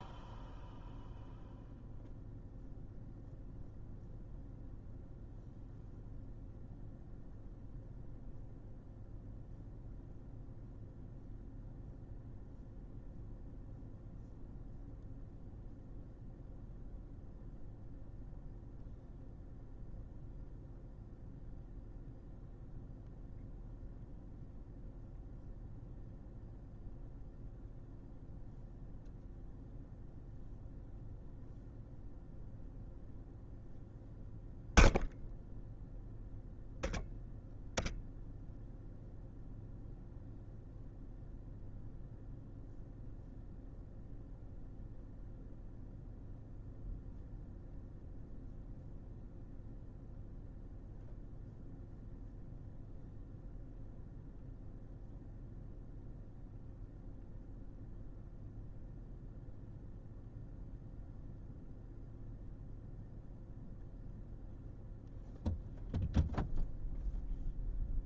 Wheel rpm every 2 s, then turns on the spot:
0, 0, 0, 0, 0, 0, 0, 0, 0, 0, 0, 0, 0, 0, 0, 0, 0, 0, 0, 0, 0, 0, 0, 0, 0, 0, 0, 0, 0, 0, 0, 0, 0, 0.
none